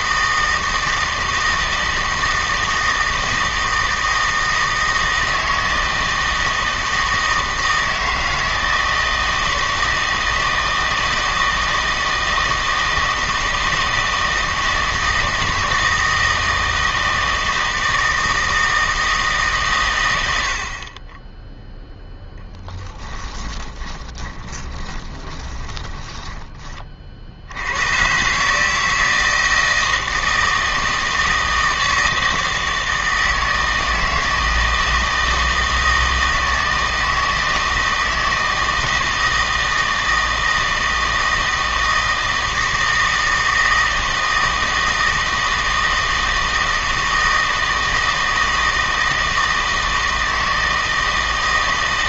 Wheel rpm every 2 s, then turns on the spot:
160, 160, 160, 160, 160, 160, 160, 160, 160, 160, 40, 10, 20, 40, 160, 160, 160, 160, 160, 160, 160, 160, 160, 160, 160, 160.
22-26